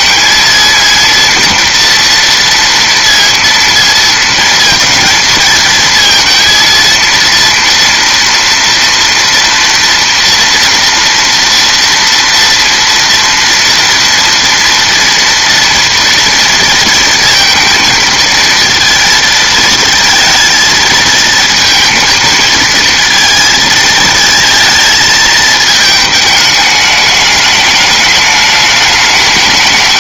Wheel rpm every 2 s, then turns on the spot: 230, 230, 230, 230, 230, 240, 230, 230, 230, 230, 230, 230, 220, 210, 210.
none